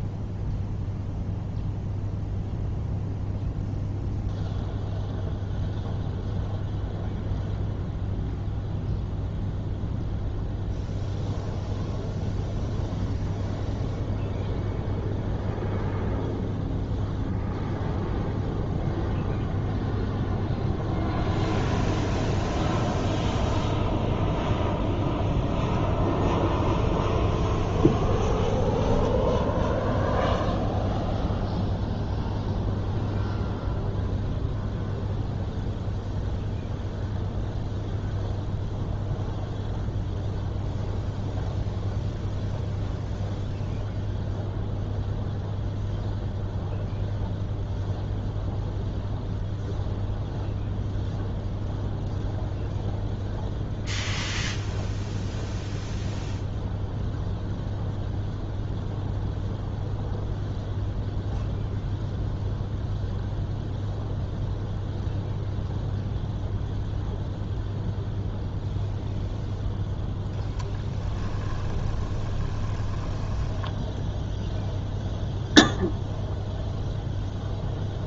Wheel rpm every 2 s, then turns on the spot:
0, 0, 0, 0, 0, 0, 0, 0, 0, 0, 0, 0, 0, 10, 10, 0, 0, 0, 0, 0, 0, 0, 0, 0, 0, 0, 0, 0, 0, 0, 0, 0, 0, 0, 0, 10, 20, 0, 0.
28-30 70-74